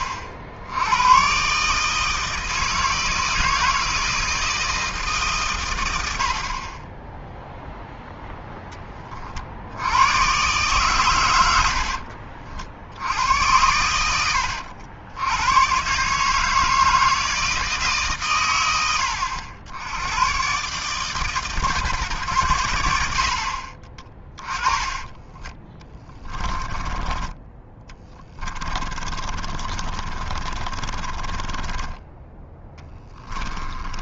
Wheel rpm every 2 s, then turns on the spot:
80, 160, 160, 40, 10, 130, 70, 80, 160, 110, 130, 90, 20, 20, 30, 30, 10.
24-32